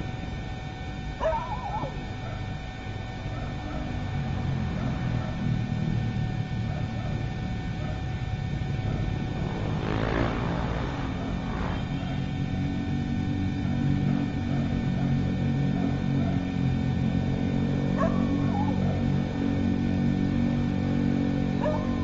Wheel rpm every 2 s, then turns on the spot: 0, 0, 0, 0, 0, 0, 0, 0, 0, 0, 0.
none